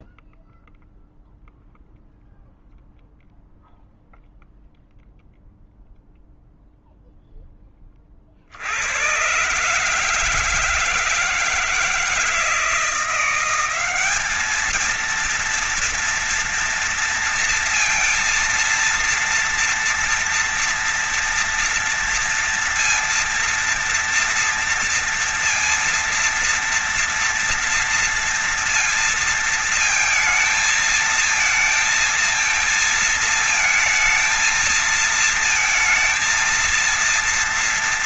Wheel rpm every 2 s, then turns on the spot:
0, 0, 0, 0, 100, 160, 170, 220, 230, 230, 230, 230, 230, 230, 230, 220, 220, 220, 230.
none